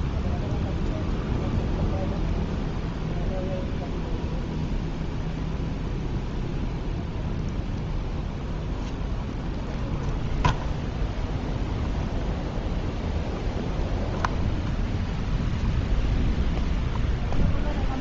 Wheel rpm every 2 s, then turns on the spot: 0, 0, 0, 0, 0, 0, 0, 0, 0.
none